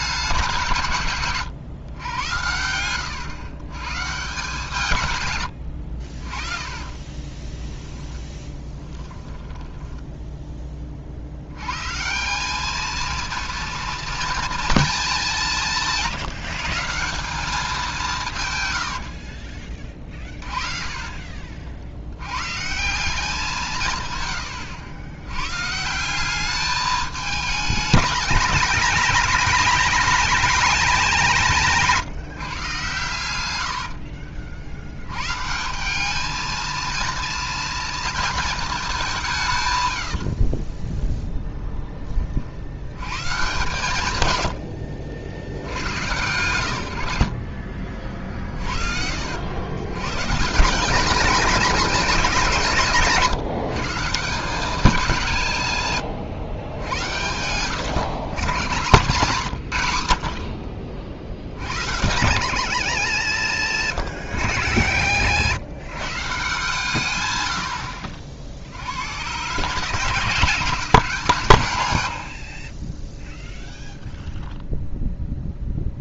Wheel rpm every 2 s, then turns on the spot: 140, 100, 140, 30, 10, 20, 210, 220, 170, 90, 40, 160, 90, 210, 220, 220, 140, 80, 220, 200, 20, 90, 80, 90, 50, 180, 170, 200, 90, 130, 50, 110, 80, 120, 80, 160, 30, 0.
6-10 18-22 40-42 44-46 64-66